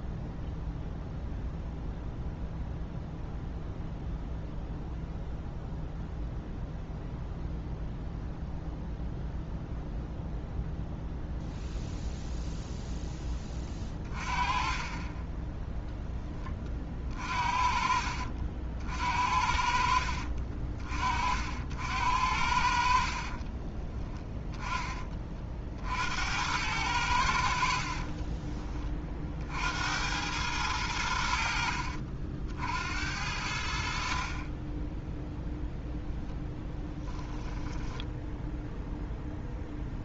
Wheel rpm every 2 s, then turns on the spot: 0, 0, 0, 0, 0, 0, 0, 30, 30, 60, 40, 50, 20, 90, 20, 90, 70, 10, 10, 0.
14-16